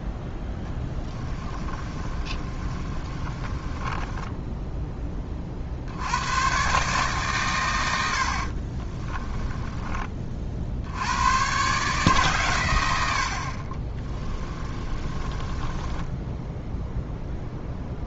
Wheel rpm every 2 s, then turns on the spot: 10, 30, 10, 130, 40, 60, 110, 20, 0.
0-4 8-10 14-16